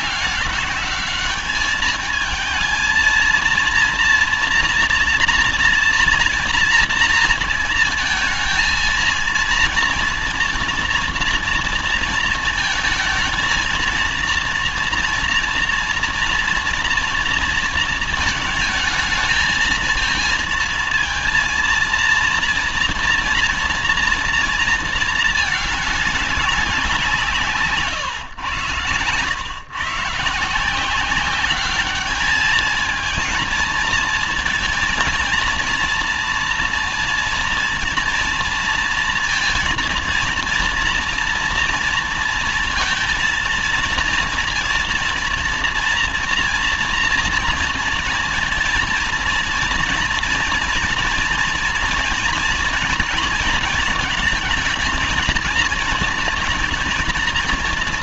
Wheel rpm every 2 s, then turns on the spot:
200, 220, 230, 230, 230, 240, 220, 230, 230, 220, 230, 240, 230, 180, 120, 170, 220, 230, 230, 230, 230, 230, 240, 230, 230, 230, 230, 230, 230.
none